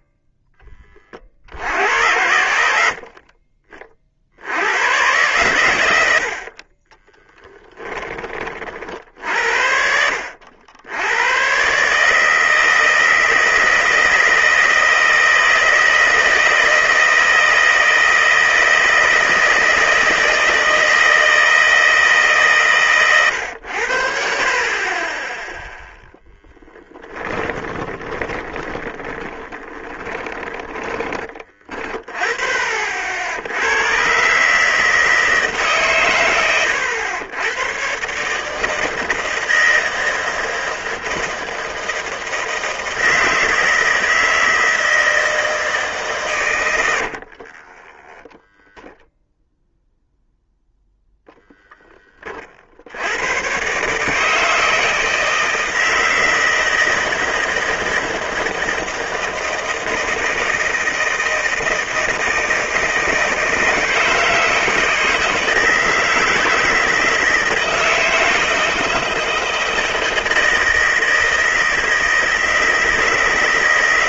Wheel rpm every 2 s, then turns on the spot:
10, 70, 100, 30, 50, 80, 160, 160, 160, 160, 160, 130, 40, 10, 20, 20, 50, 150, 100, 160, 160, 160, 160, 100, 0, 0, 70, 160, 160, 160, 160, 160, 160, 160, 160, 160, 160.
26-30 46-48